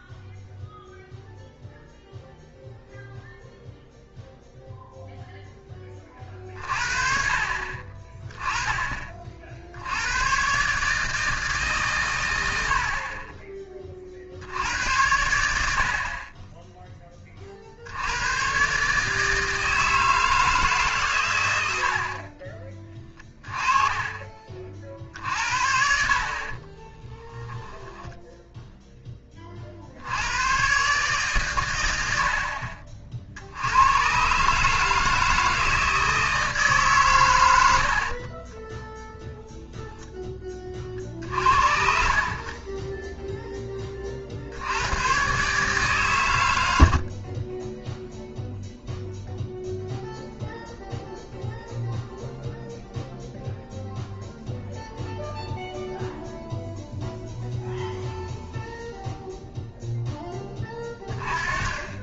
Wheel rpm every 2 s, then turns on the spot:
0, 0, 0, 50, 20, 140, 70, 80, 20, 130, 150, 30, 40, 30, 0, 120, 50, 150, 150, 20, 40, 30, 80, 90, 0, 0, 0, 0, 0, 0, 20.
26-28 38-40